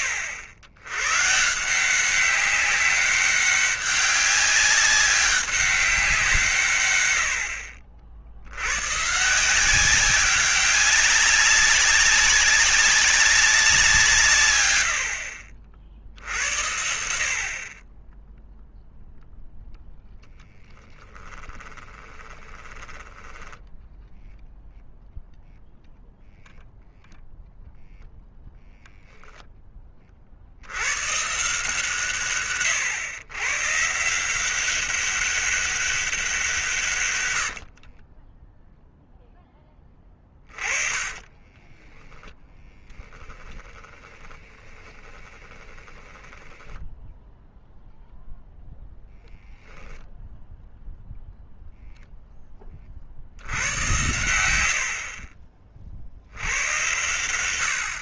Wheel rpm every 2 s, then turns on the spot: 100, 190, 200, 130, 110, 190, 190, 90, 70, 0, 20, 20, 0, 0, 0, 70, 120, 190, 150, 10, 20, 10, 20, 10, 0, 0, 20, 90, 90.
20-24 40-42 44-48